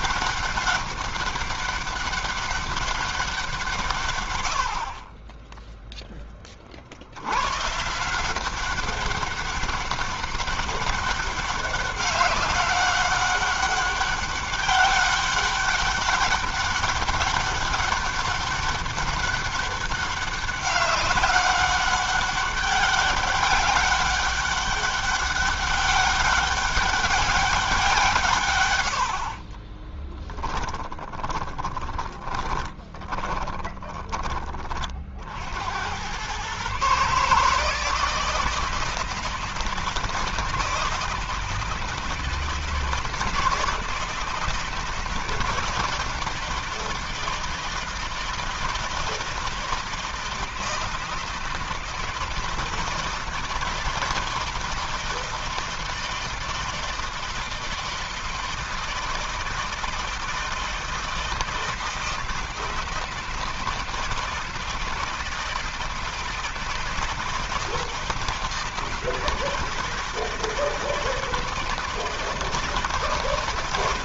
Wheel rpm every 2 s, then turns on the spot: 200, 200, 70, 30, 180, 200, 200, 200, 200, 200, 200, 200, 200, 200, 120, 10, 20, 20, 110, 160, 160, 160, 160, 160, 160, 160, 160, 160, 160, 160, 160, 160, 160, 160, 160, 160, 160.
30-34